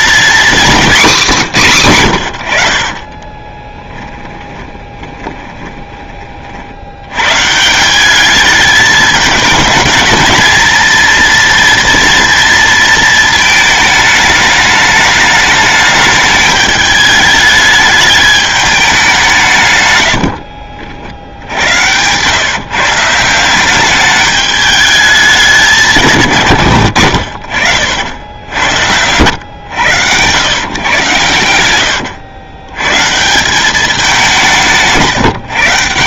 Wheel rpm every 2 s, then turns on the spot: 230, 60, 20, 90, 210, 230, 230, 210, 210, 200, 60, 150, 210, 110, 90, 130, 120, 160.
2-6